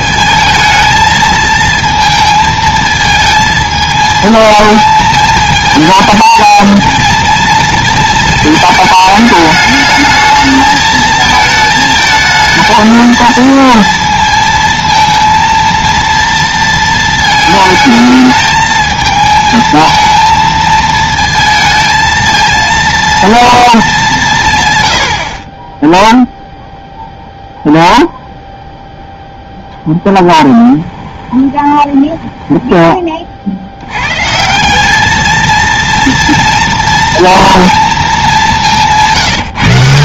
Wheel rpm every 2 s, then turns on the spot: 220, 220, 220, 230, 220, 220, 220, 230, 220, 220, 220, 230, 110, 0, 0, 10, 20, 200, 230, 180.
30-32